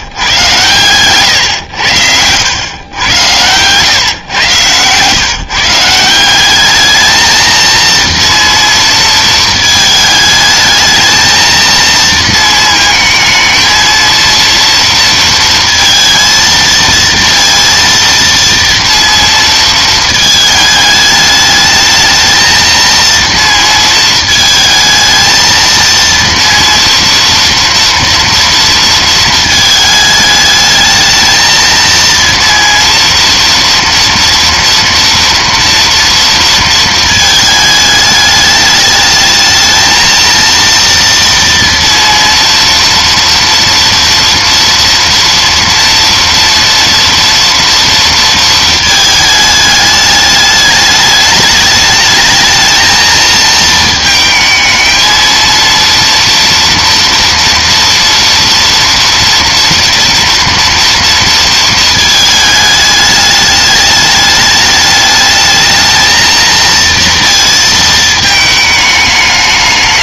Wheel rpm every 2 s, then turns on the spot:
110, 110, 120, 210, 230, 220, 220, 230, 230, 230, 210, 230, 220, 230, 230, 220, 230, 240, 230, 210, 230, 230, 230, 230, 220, 210, 220, 220, 230, 230, 230, 210, 210, 230, 220.
none